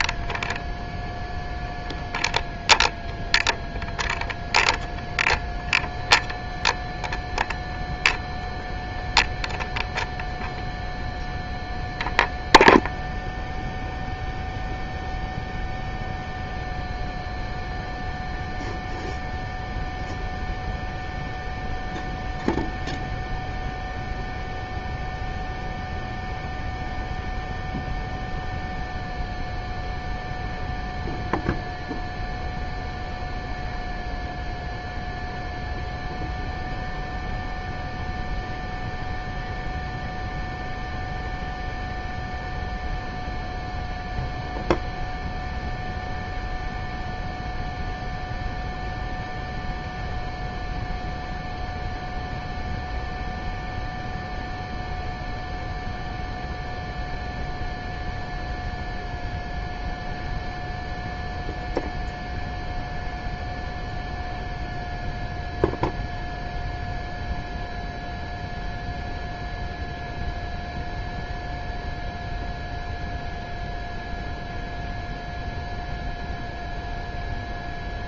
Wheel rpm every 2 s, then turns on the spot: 0, 0, 0, 0, 0, 0, 0, 0, 0, 0, 0, 0, 0, 0, 0, 0, 0, 0, 0, 0, 0, 0, 0, 0, 0, 0, 0, 0, 0, 0, 0, 0, 0, 0, 0, 0, 0, 0, 0.
none